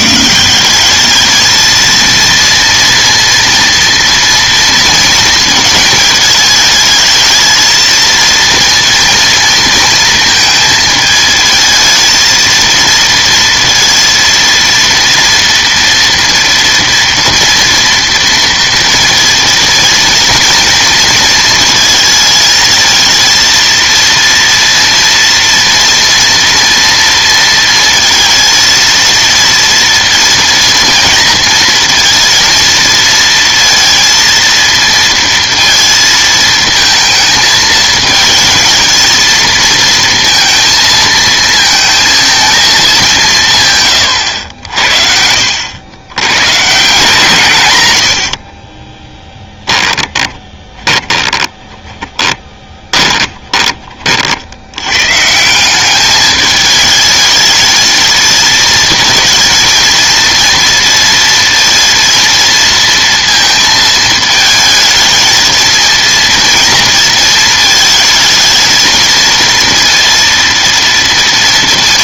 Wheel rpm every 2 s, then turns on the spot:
180, 230, 230, 220, 230, 220, 230, 230, 230, 230, 230, 220, 230, 230, 230, 230, 230, 230, 220, 220, 220, 220, 80, 140, 30, 20, 10, 90, 220, 220, 230, 230, 220, 230, 220, 230.
48-54